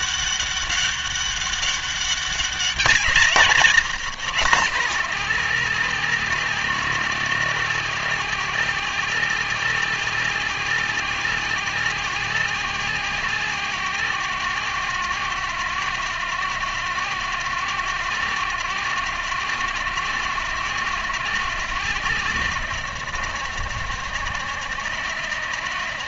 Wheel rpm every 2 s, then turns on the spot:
200, 190, 180, 180, 180, 180, 180, 180, 170, 170, 180, 170, 170.
none